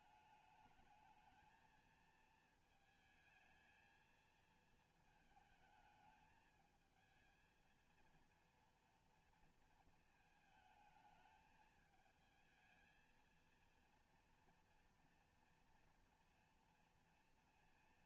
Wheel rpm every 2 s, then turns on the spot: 210, 220, 220, 220, 230, 220, 220, 230, 230.
none